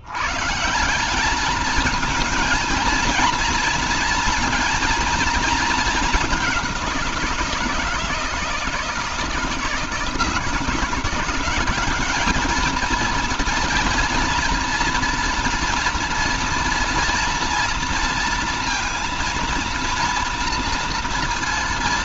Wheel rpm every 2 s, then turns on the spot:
140, 220, 230, 200, 160, 170, 220, 230, 230, 230, 230.
none